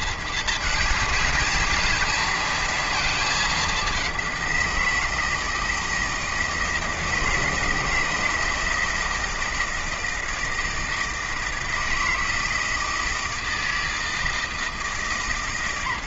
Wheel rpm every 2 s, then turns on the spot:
220, 230, 180, 160, 160, 160, 160, 160.
none